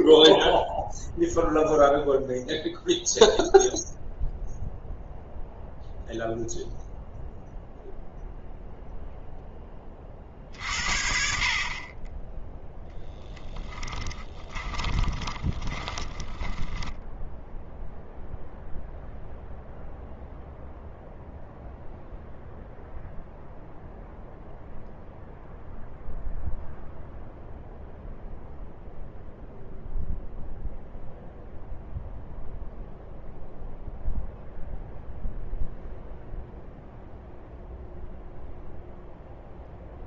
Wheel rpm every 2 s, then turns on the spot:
0, 0, 0, 0, 0, 60, 10, 20, 10, 0, 0, 0, 0, 0, 0, 0, 0, 0, 0, 0.
14-18